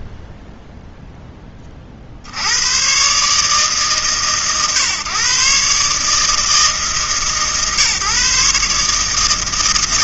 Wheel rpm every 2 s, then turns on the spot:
80, 130, 150, 150, 160.
none